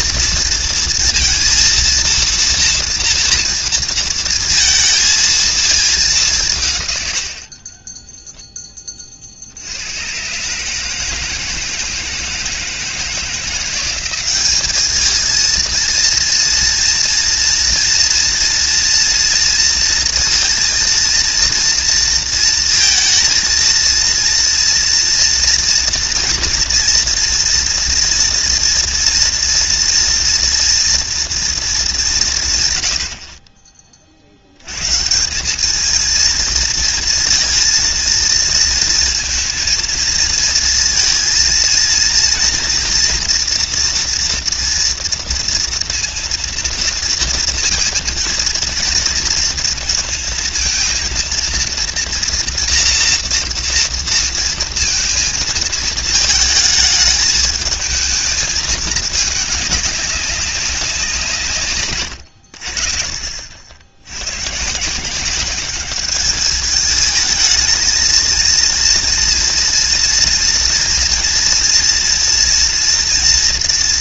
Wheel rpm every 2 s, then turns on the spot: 230, 230, 230, 160, 20, 140, 160, 200, 230, 230, 230, 230, 230, 230, 240, 230, 140, 90, 230, 230, 230, 230, 230, 230, 230, 230, 240, 230, 220, 220, 190, 80, 130, 210, 230, 230, 230.
none